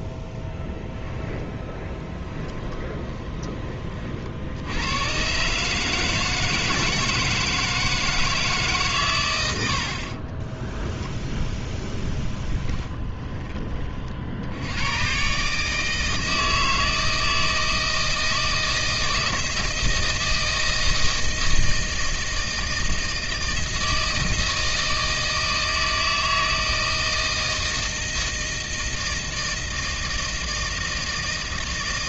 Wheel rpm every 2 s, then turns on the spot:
0, 10, 80, 160, 150, 20, 10, 80, 160, 160, 160, 160, 160, 160, 160, 160.
2-4 10-14